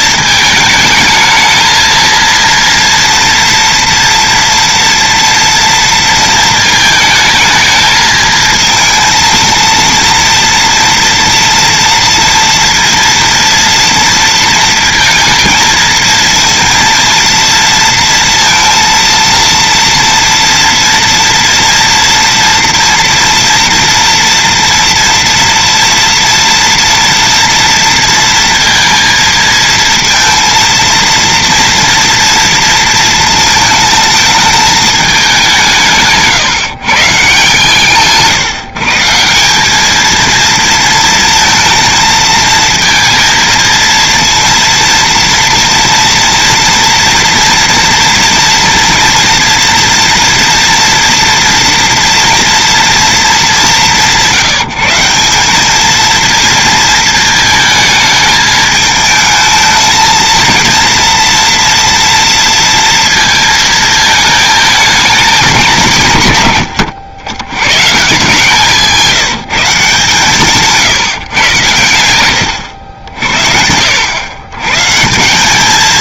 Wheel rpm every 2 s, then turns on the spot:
220, 230, 230, 220, 220, 230, 230, 230, 230, 230, 230, 230, 230, 230, 230, 230, 230, 220, 150, 140, 230, 230, 230, 230, 230, 230, 230, 170, 230, 220, 230, 230, 220, 110, 170, 150, 80, 120.
none